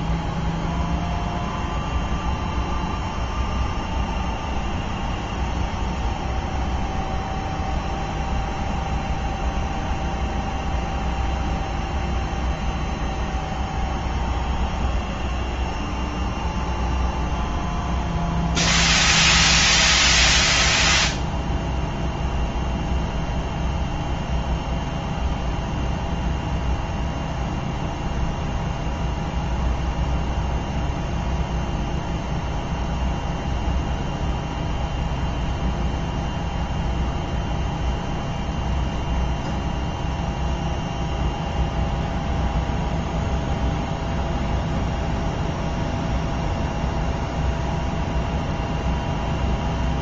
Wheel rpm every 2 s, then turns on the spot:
0, 0, 0, 0, 0, 0, 0, 0, 0, 0, 0, 0, 0, 0, 0, 0, 0, 0, 0, 0, 0, 0, 0, 0, 0.
none